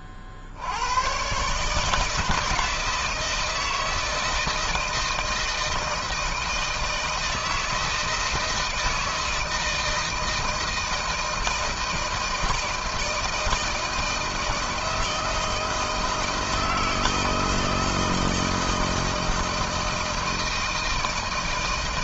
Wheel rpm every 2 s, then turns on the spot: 60, 160, 160, 160, 160, 160, 160, 160, 160, 160, 160.
none